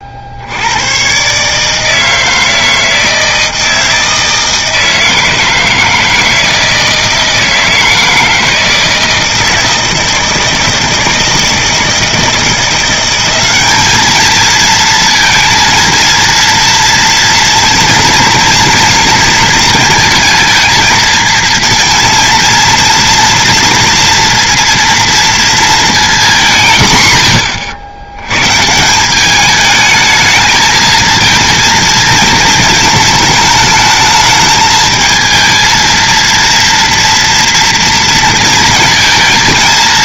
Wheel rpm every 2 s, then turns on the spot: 90, 160, 160, 160, 160, 160, 170, 220, 230, 230, 220, 230, 230, 170, 150, 220, 220, 220, 230, 220.
none